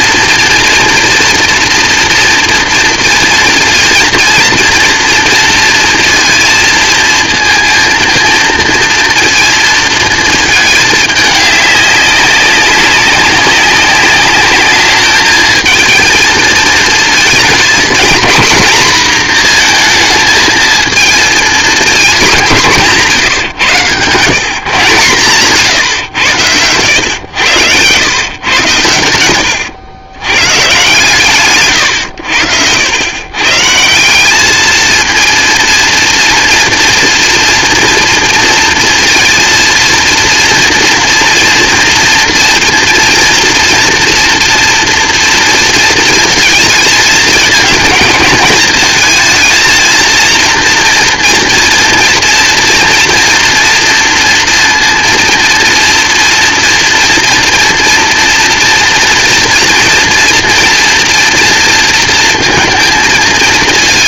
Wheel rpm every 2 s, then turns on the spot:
230, 230, 230, 230, 230, 220, 200, 200, 220, 230, 230, 190, 150, 110, 110, 140, 80, 220, 230, 230, 230, 230, 240, 230, 220, 230, 230, 230, 230, 230, 240, 230.
none